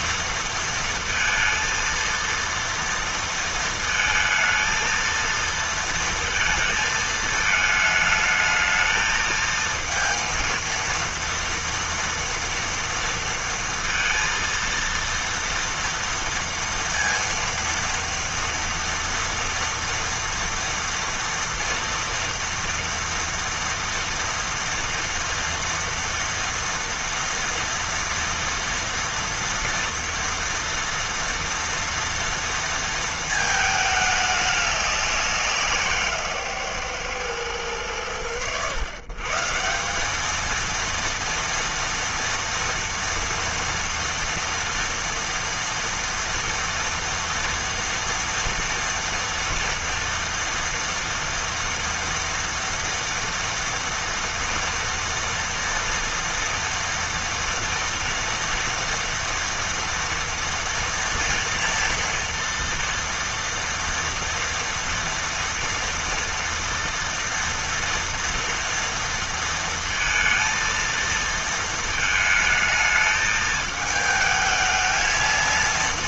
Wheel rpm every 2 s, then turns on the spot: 230, 230, 230, 230, 220, 230, 230, 230, 230, 230, 230, 230, 230, 230, 230, 230, 230, 210, 140, 90, 220, 230, 230, 230, 230, 230, 230, 230, 230, 240, 230, 230, 230, 230, 230, 230, 220, 220.
none